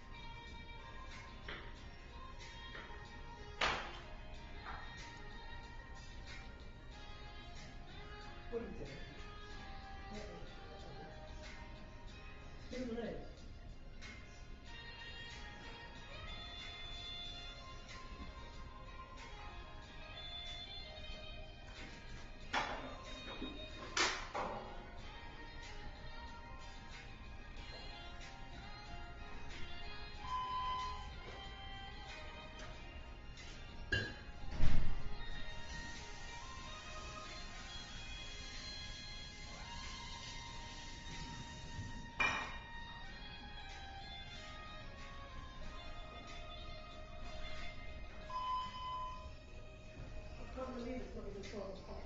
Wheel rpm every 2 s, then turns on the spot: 0, 0, 0, 0, 0, 0, 0, 0, 0, 0, 0, 0, 0, 0, 0, 0, 0, 0, 0, 0, 0, 0, 0, 0, 0, 0.
none